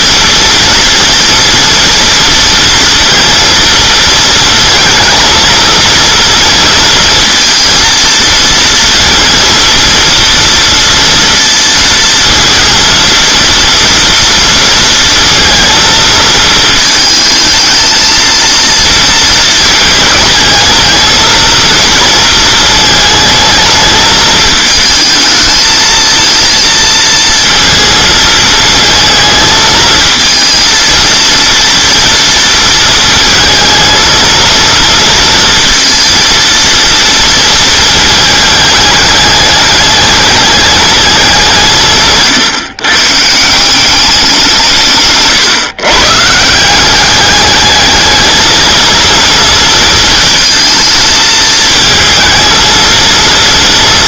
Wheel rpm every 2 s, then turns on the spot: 230, 230, 230, 230, 230, 230, 230, 230, 220, 230, 220, 220, 220, 230, 220, 230, 230, 230, 230, 210, 210, 140, 160, 170, 230, 220, 230.
none